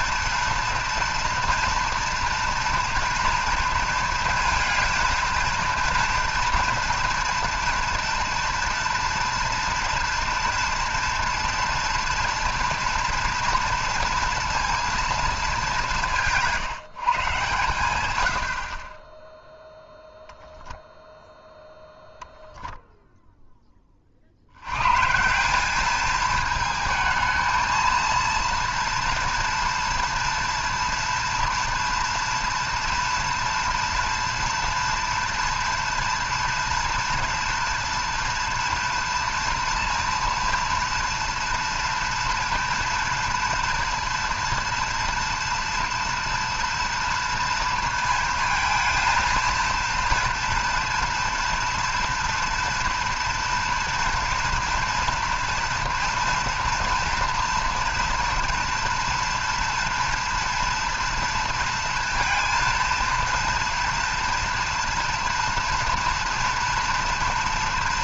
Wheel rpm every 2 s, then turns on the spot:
230, 240, 230, 230, 230, 230, 230, 230, 160, 50, 0, 0, 100, 220, 240, 230, 230, 230, 230, 230, 230, 230, 230, 230, 230, 230, 230, 230, 230, 230, 230, 230, 230, 240.
none